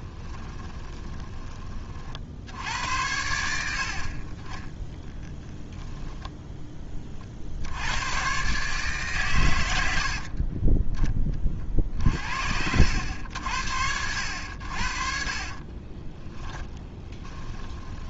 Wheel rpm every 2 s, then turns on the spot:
20, 80, 10, 20, 140, 20, 70, 70, 30.
0-2 16-18